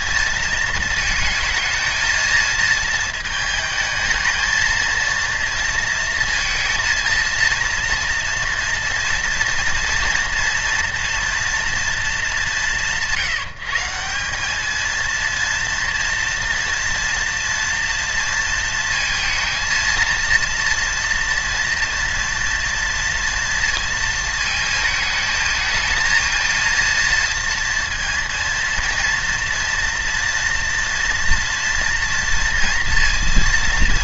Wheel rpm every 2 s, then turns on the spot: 230, 230, 230, 230, 230, 240, 160, 220, 230, 220, 230, 230, 220, 230, 230, 230, 230.
none